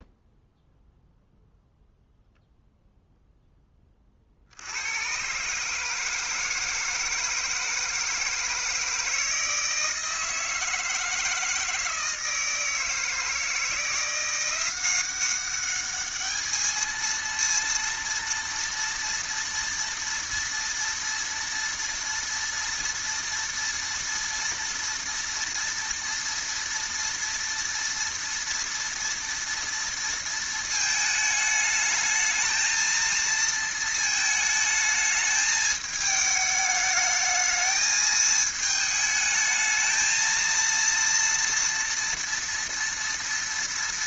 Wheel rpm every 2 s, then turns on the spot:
0, 0, 80, 160, 160, 160, 160, 180, 220, 230, 230, 230, 230, 230, 230, 220, 220, 220, 220, 220, 230, 230.
none